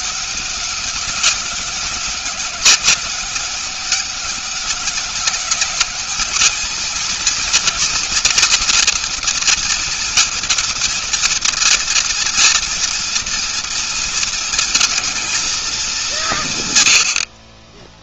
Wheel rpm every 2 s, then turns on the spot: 200, 190, 200, 210, 240, 230, 230, 230, 170.
none